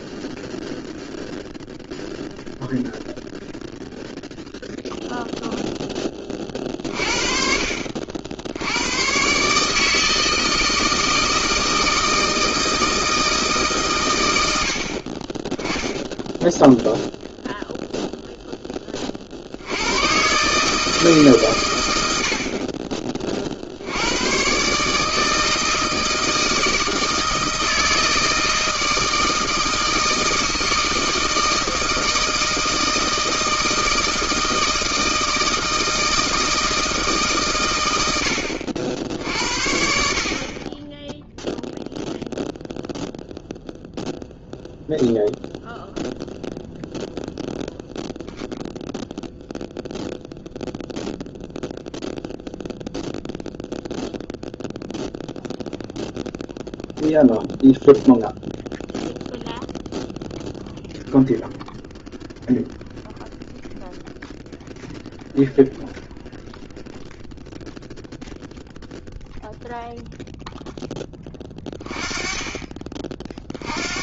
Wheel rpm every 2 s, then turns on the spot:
0, 0, 0, 20, 70, 160, 160, 90, 10, 0, 130, 70, 110, 160, 160, 160, 160, 160, 160, 80, 40, 0, 0, 0, 0, 0, 0, 0, 0, 0, 0, 0, 0, 0, 0, 0, 20.
none